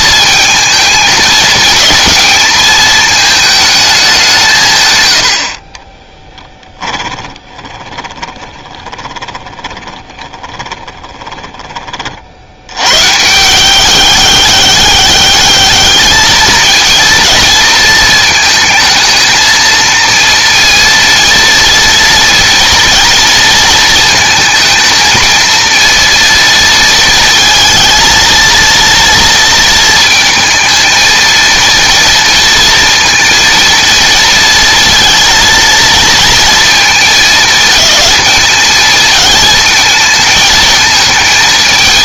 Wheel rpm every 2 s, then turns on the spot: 220, 220, 110, 10, 20, 20, 100, 200, 220, 220, 230, 230, 230, 230, 230, 230, 230, 230, 230, 220, 220.
6-12